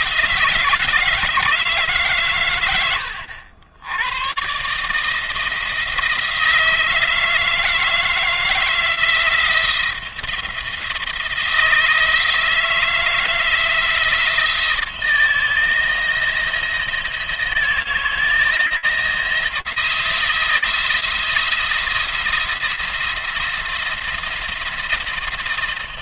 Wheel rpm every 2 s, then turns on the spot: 160, 100, 150, 160, 170, 170, 160, 160, 170, 170, 170, 170, 170.
none